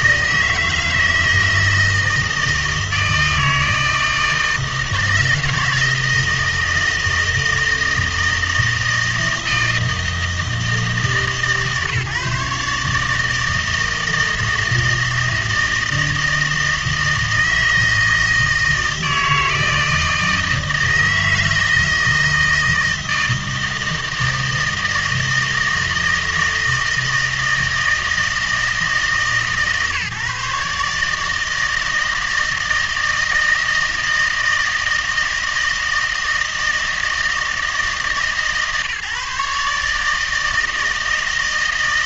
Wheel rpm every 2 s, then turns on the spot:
160, 160, 160, 160, 160, 160, 140, 160, 160, 160, 160, 160, 160, 160, 160, 150, 160, 160, 160, 140, 160.
none